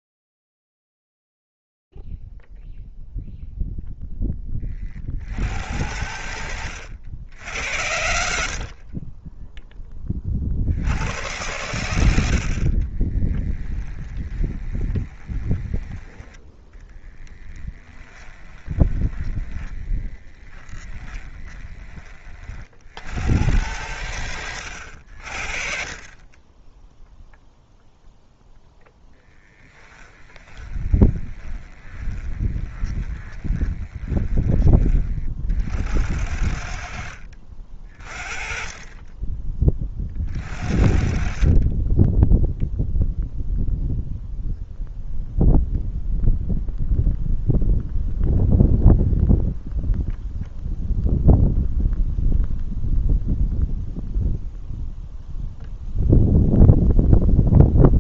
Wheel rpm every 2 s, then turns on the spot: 0, 0, 10, 100, 60, 40, 70, 20, 20, 20, 20, 80, 80, 10, 10, 20, 20, 30, 60, 20, 50, 0, 0, 0, 0, 0, 0, 0, 0.
14-22 30-34